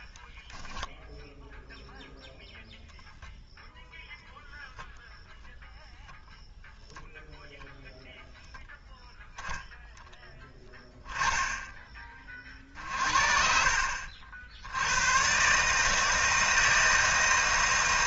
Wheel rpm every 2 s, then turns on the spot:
0, 0, 0, 0, 0, 10, 40, 80, 160.
10-12